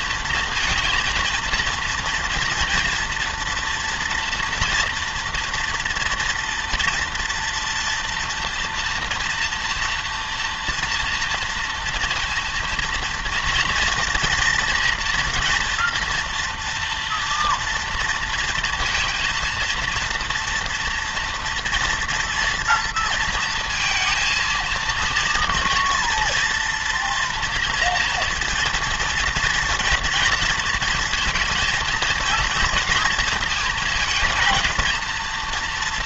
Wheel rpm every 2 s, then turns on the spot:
230, 230, 230, 230, 230, 230, 230, 230, 230, 230, 230, 230, 230, 230, 230, 230, 230, 220.
none